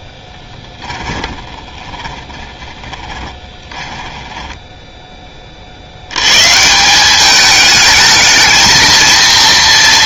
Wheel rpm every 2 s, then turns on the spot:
20, 40, 10, 170, 220.
0-4